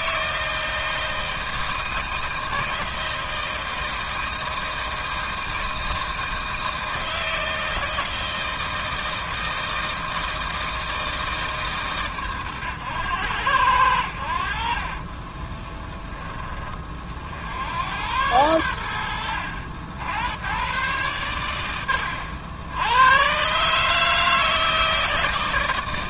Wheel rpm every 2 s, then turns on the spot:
160, 160, 160, 160, 160, 160, 110, 20, 40, 90, 120, 100, 150.
14-16